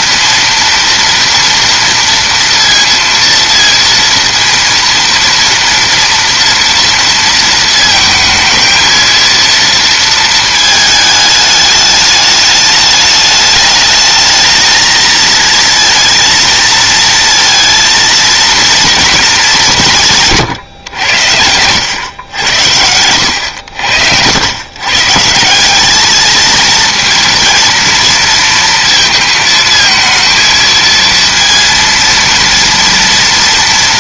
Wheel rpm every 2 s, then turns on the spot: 230, 230, 230, 230, 220, 220, 210, 220, 230, 220, 110, 90, 130, 230, 230, 230, 230.
none